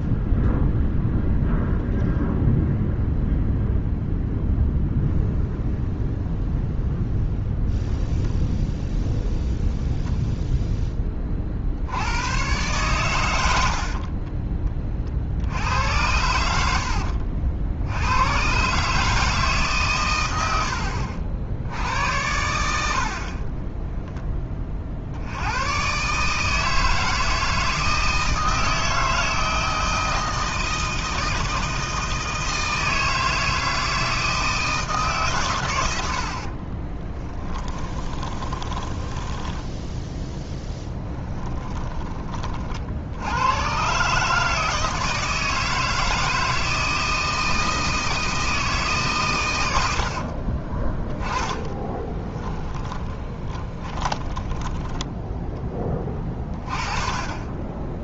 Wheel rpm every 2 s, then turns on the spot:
0, 0, 0, 0, 0, 10, 120, 30, 70, 140, 70, 80, 40, 160, 160, 160, 160, 160, 30, 10, 20, 50, 160, 160, 150, 30, 20, 10, 30.
36-42 50-56